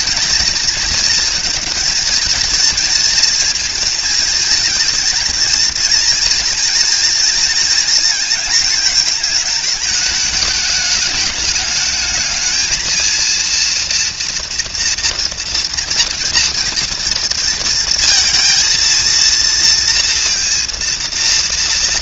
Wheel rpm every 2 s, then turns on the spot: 220, 230, 230, 230, 220, 210, 220, 230, 230, 230, 230.
none